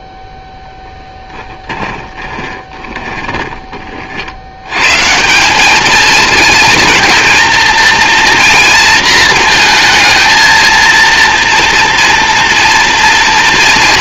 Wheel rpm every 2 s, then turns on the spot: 0, 20, 110, 220, 230, 230, 230.
2-4